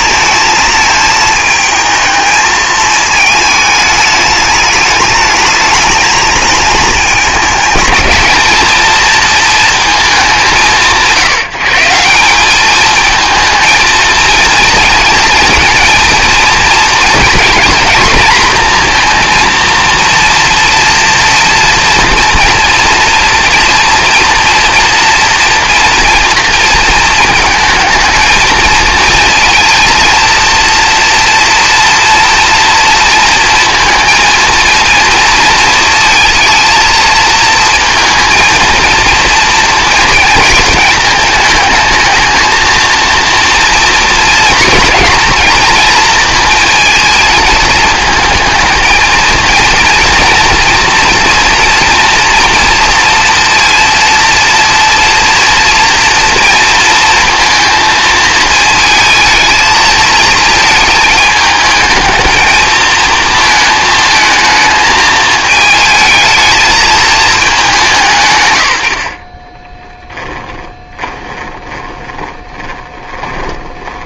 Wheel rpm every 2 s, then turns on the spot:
220, 210, 220, 230, 180, 190, 220, 230, 230, 230, 230, 230, 230, 220, 230, 230, 230, 230, 230, 230, 220, 230, 230, 230, 230, 230, 230, 230, 220, 220, 220, 220, 220, 140, 10, 20, 30.
68-72